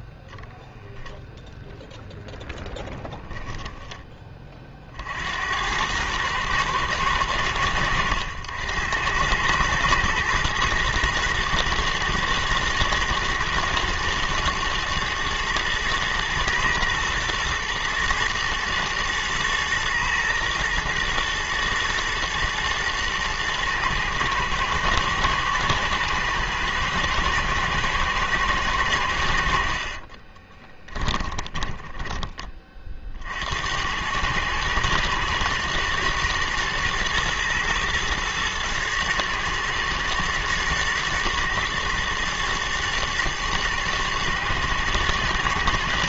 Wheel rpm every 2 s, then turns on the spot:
0, 10, 50, 110, 90, 110, 110, 110, 120, 110, 120, 110, 110, 110, 100, 20, 40, 110, 110, 120, 110, 110, 110.
30-32